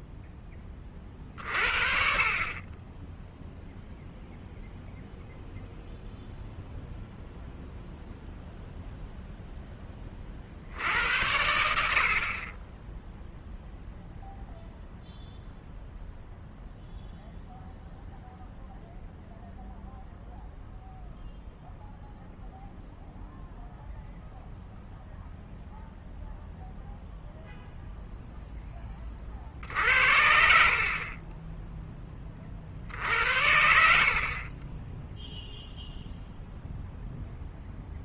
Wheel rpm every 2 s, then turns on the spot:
30, 20, 0, 0, 0, 90, 10, 0, 0, 0, 0, 0, 0, 0, 20, 50, 50, 10, 0.
none